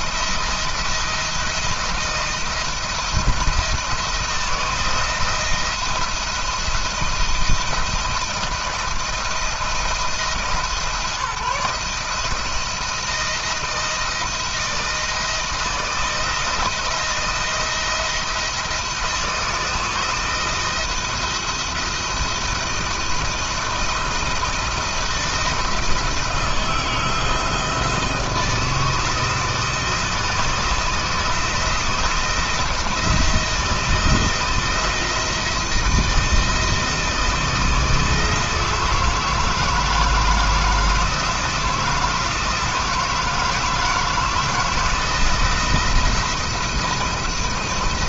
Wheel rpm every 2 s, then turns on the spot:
170, 170, 170, 160, 170, 160, 160, 160, 170, 170, 170, 170, 160, 160, 170, 170, 170, 160, 160, 160, 160, 160, 160, 160.
none